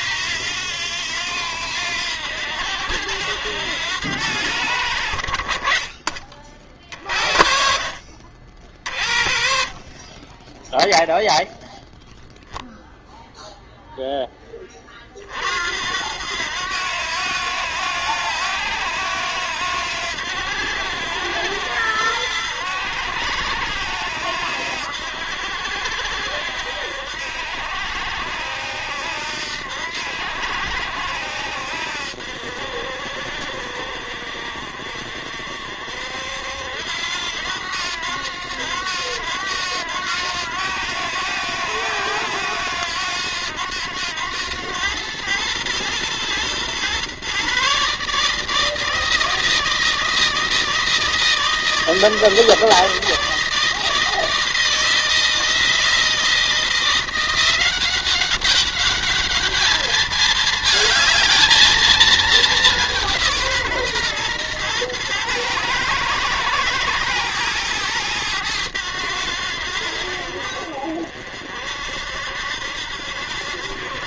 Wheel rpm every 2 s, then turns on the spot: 90, 80, 80, 40, 50, 10, 0, 20, 90, 90, 80, 80, 80, 70, 80, 80, 60, 60, 70, 90, 90, 90, 100, 120, 160, 160, 160, 160, 170, 200, 220, 200, 120, 110, 100, 60, 70.
none